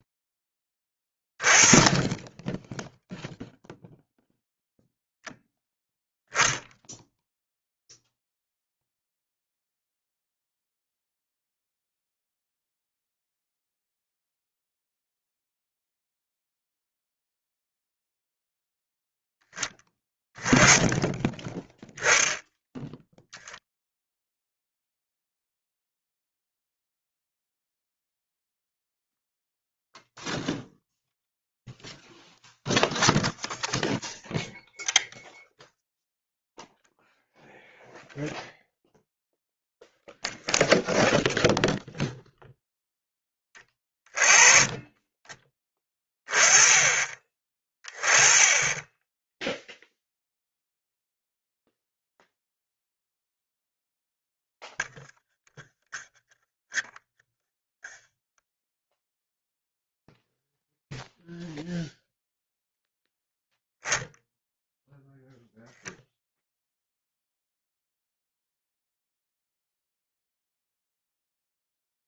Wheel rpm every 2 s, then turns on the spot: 10, 10, 0, 0, 0, 0, 0, 0, 0, 0, 10, 10, 0, 0, 0, 0, 0, 0, 0, 0, 0, 0, 20, 20, 20, 0, 0, 0, 0, 0, 0, 0, 0, 0, 0, 0.
none